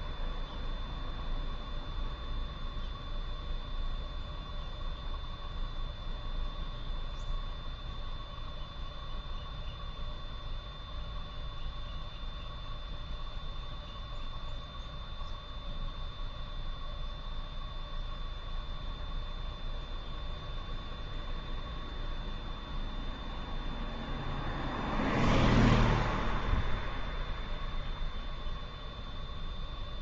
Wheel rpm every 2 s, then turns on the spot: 0, 0, 0, 0, 0, 0, 0, 0, 0, 0, 0, 0, 0, 0, 0.
none